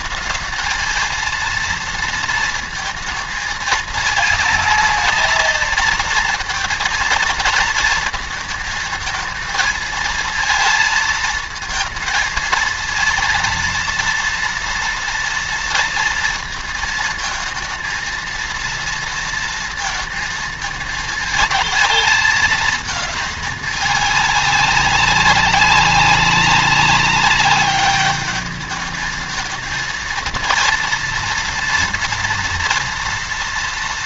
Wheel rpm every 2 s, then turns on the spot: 220, 230, 230, 230, 220, 220, 220, 230, 220, 230, 220, 220, 200, 190, 210, 230, 230.
none